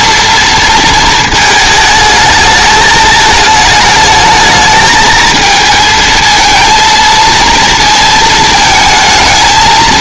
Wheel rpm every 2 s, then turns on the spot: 230, 220, 220, 230, 220.
none